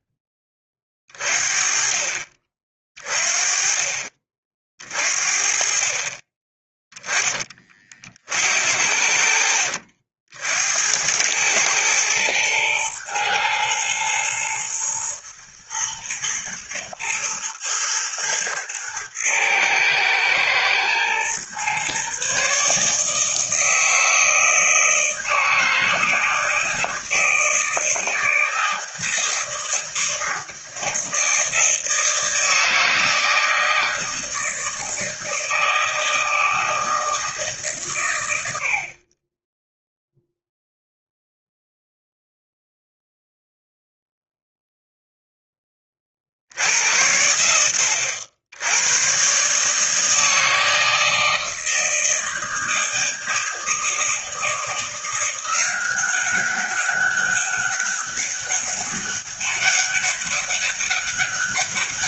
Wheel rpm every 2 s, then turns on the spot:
30, 30, 40, 10, 70, 80, 110, 120, 120, 120, 120, 150, 160, 160, 160, 160, 160, 160, 160, 60, 0, 0, 0, 80, 100, 160, 160, 170, 200, 200, 200.
none